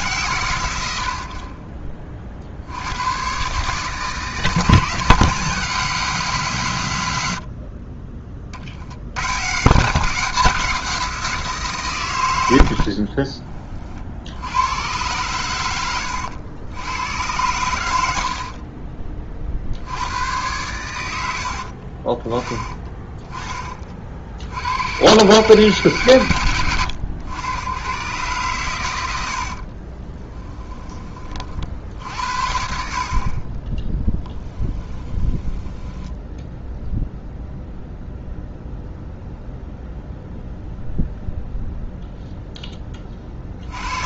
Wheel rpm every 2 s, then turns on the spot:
110, 70, 160, 130, 70, 190, 80, 90, 90, 40, 100, 20, 100, 100, 110, 10, 60, 10, 0, 0, 0, 10.
18-20 22-24 34-36